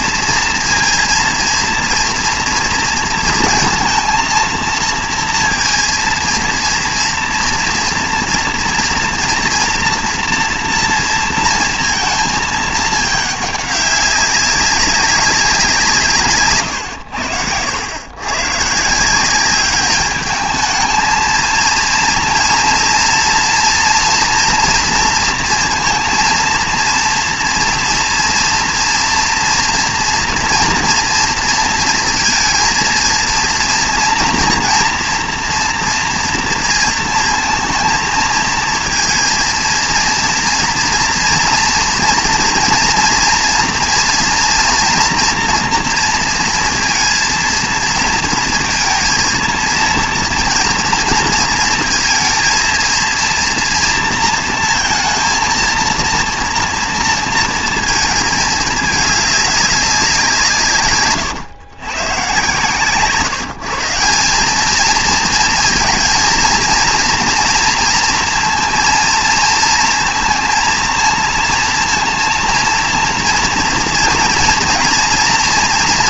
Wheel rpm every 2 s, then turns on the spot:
230, 230, 230, 230, 230, 240, 220, 200, 130, 130, 210, 230, 230, 230, 230, 230, 230, 230, 230, 230, 240, 240, 230, 230, 230, 230, 230, 230, 230, 220, 160, 130, 200, 230, 230, 230, 230, 230.
16-18